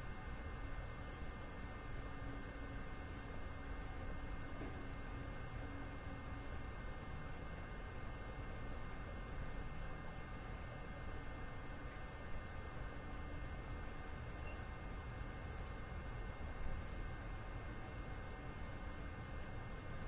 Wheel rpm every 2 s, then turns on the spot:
0, 0, 0, 0, 0, 0, 0, 0, 0, 0.
none